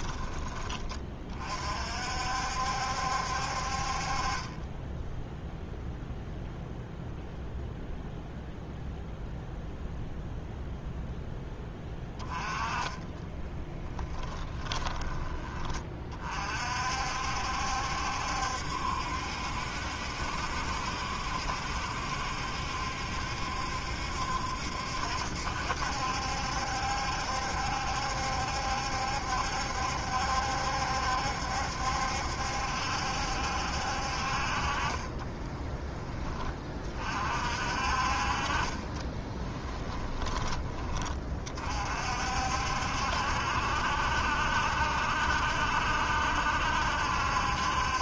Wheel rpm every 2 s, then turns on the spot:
30, 70, 20, 0, 0, 0, 20, 10, 50, 70, 70, 70, 70, 70, 70, 70, 70, 30, 30, 20, 30, 60, 70, 70.
12-16 38-40